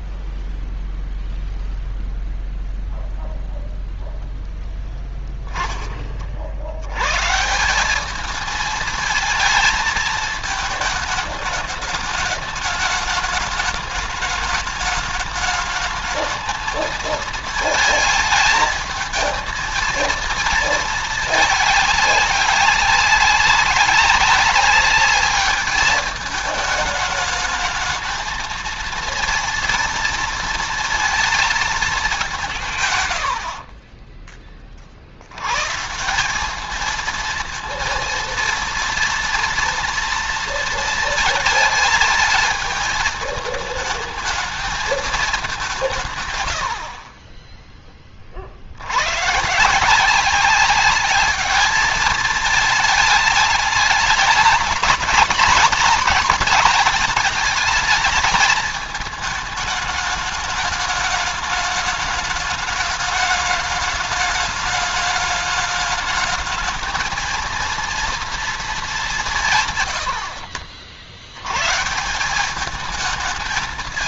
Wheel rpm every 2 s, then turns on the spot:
0, 0, 0, 60, 220, 220, 210, 210, 220, 220, 220, 200, 200, 210, 220, 230, 160, 30, 200, 230, 230, 220, 220, 80, 80, 200, 210, 210, 220, 220, 210, 210, 210, 220, 220, 70, 210.
none